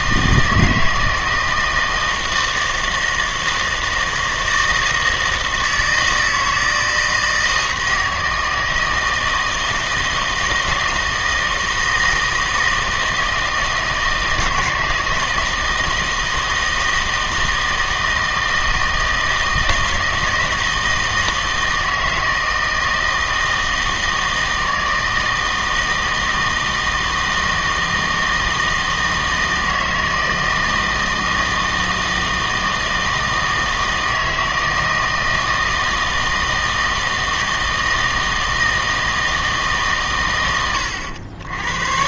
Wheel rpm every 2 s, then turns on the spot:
160, 160, 160, 160, 160, 160, 160, 160, 160, 160, 160, 160, 160, 160, 160, 160, 160, 160, 160, 160, 90.
none